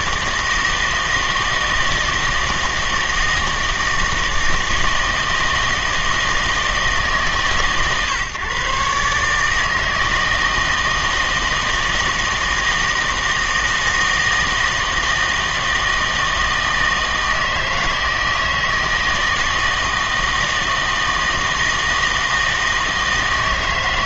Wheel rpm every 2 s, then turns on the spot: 160, 160, 160, 160, 140, 160, 160, 160, 160, 160, 160, 160.
none